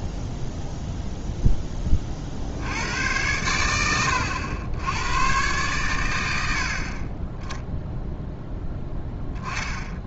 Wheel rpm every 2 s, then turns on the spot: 0, 80, 90, 60, 10.
6-8